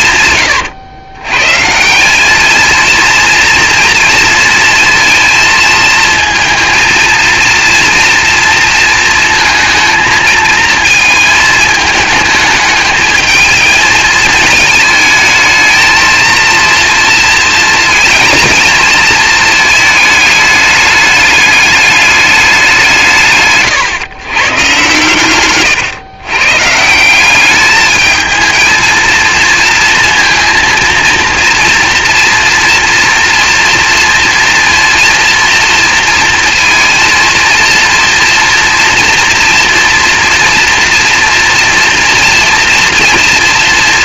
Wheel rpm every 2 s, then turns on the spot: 110, 230, 230, 230, 230, 220, 220, 220, 230, 220, 210, 160, 130, 170, 220, 230, 230, 230, 230, 240, 230, 240.
none